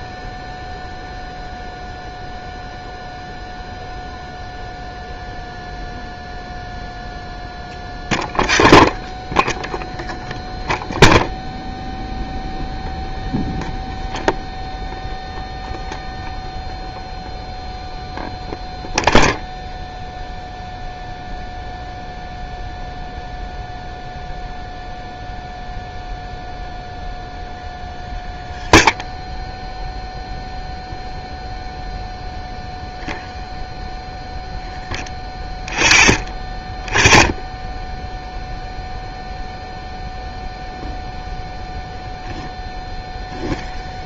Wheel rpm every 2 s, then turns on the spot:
0, 0, 0, 0, 0, 0, 0, 0, 0, 0, 0, 0, 0, 0, 0, 0, 0, 0, 0, 0, 0, 0.
none